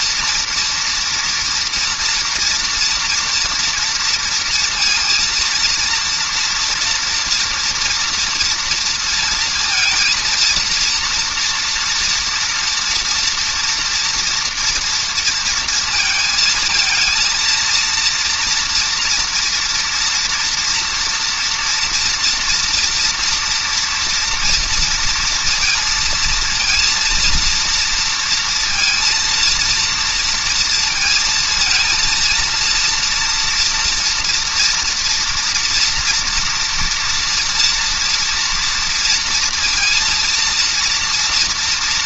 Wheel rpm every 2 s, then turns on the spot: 230, 230, 230, 240, 230, 230, 230, 230, 230, 230, 230, 230, 230, 230, 230, 220, 230, 230, 230, 230, 230.
none